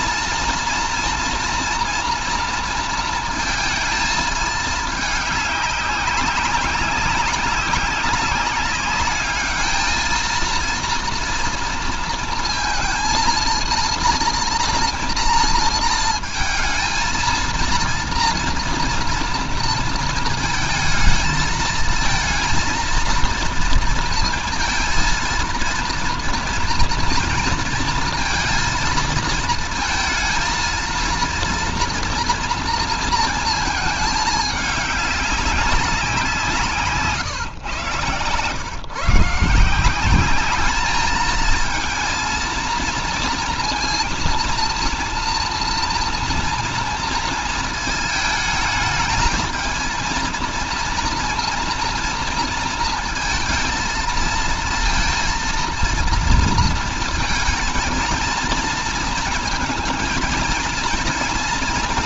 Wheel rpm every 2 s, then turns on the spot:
230, 230, 220, 190, 200, 230, 230, 230, 220, 230, 230, 230, 230, 230, 230, 230, 230, 210, 160, 130, 200, 230, 230, 230, 220, 230, 230, 230, 230, 230, 230.
none